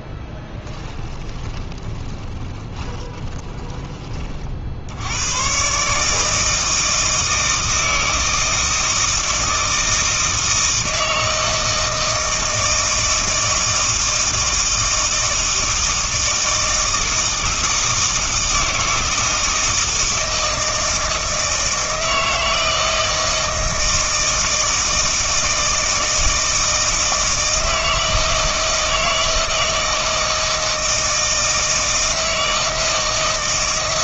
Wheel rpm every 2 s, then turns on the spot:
20, 20, 50, 160, 160, 160, 160, 160, 160, 160, 160, 160, 160, 160, 160, 160, 160.
0-4